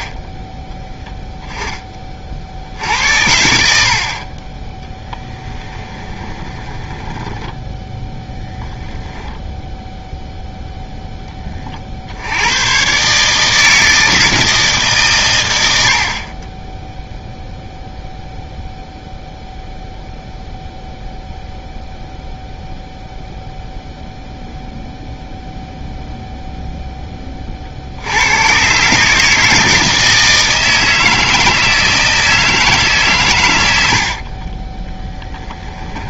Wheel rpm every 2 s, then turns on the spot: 10, 70, 20, 20, 0, 0, 120, 150, 10, 0, 0, 0, 0, 0, 130, 160, 150, 20.
6-8